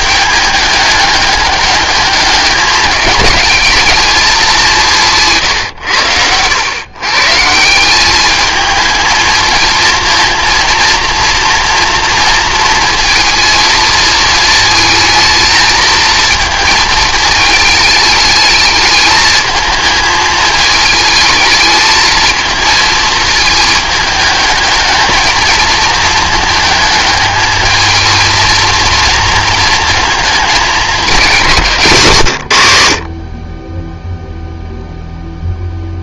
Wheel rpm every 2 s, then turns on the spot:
210, 200, 180, 120, 220, 230, 230, 220, 220, 210, 220, 220, 210, 210, 230, 200, 80, 0.
none